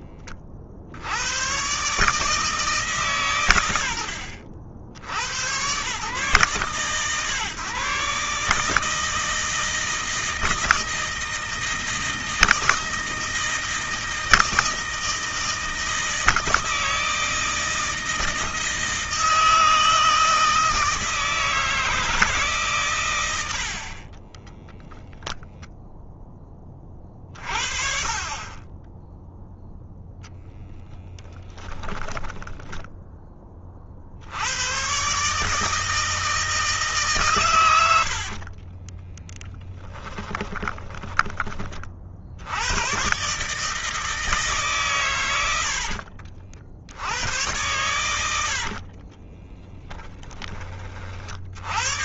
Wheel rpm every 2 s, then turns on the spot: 60, 140, 100, 130, 150, 160, 160, 160, 160, 160, 160, 120, 0, 20, 10, 10, 10, 120, 160, 30, 20, 110, 130, 100, 50, 40.
30-32 38-42 48-50